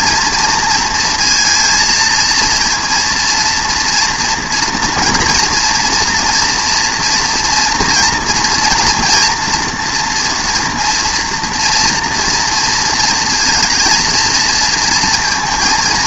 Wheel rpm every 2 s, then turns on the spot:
230, 230, 240, 230, 230, 240, 230, 230.
none